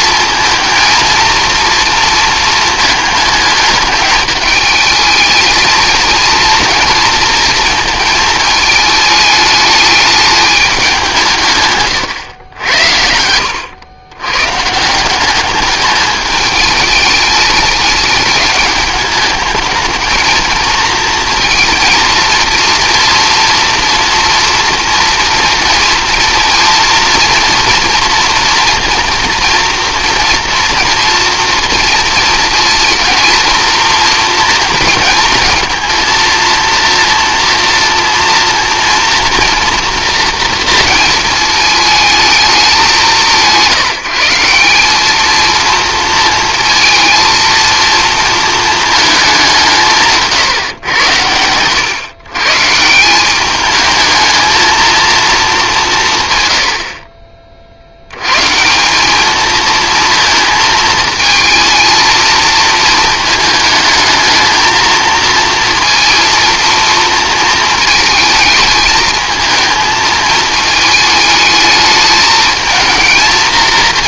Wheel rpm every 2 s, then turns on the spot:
230, 220, 210, 230, 220, 200, 80, 160, 210, 210, 230, 230, 230, 230, 230, 230, 230, 230, 230, 230, 230, 200, 190, 230, 220, 120, 160, 220, 90, 170, 220, 230, 220, 230, 220, 220, 220.
none